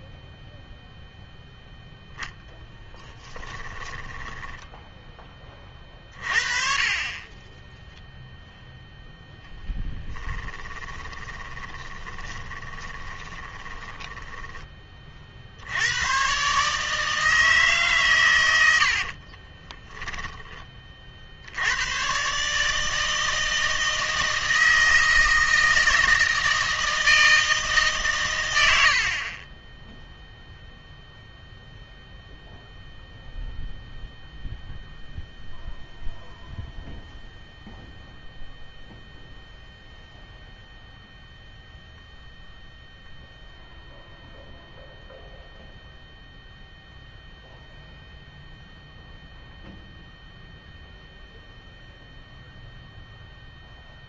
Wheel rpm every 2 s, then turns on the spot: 0, 10, 10, 40, 0, 30, 20, 20, 140, 70, 30, 160, 160, 160, 80, 0, 0, 0, 0, 0, 0, 0, 0, 0, 0, 0, 0.
2-6 10-14